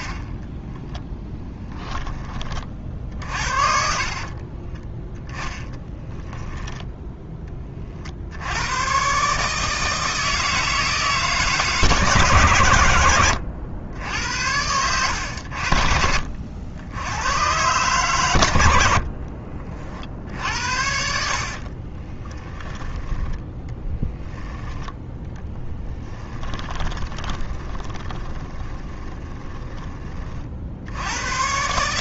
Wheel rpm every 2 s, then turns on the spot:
10, 50, 20, 0, 110, 160, 110, 100, 90, 80, 60, 10, 10, 20, 20, 60.
0-6 22-24 26-30